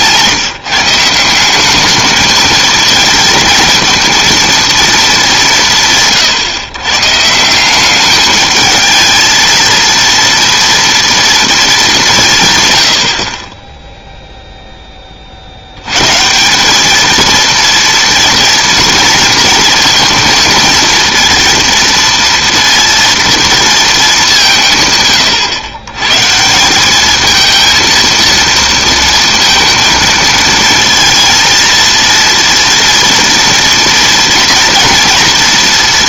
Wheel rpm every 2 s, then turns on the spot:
160, 220, 230, 140, 220, 230, 100, 10, 210, 230, 230, 230, 150, 200, 230, 230, 230, 230.
none